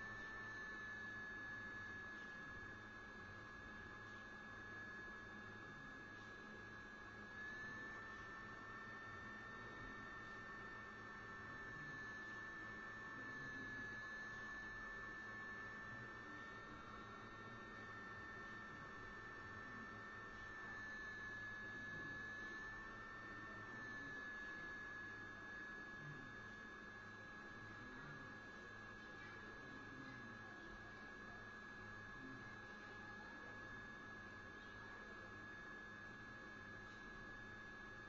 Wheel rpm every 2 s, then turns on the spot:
0, 0, 0, 0, 0, 0, 0, 0, 0, 0, 0, 0, 0, 0, 0, 0, 0, 0, 0.
none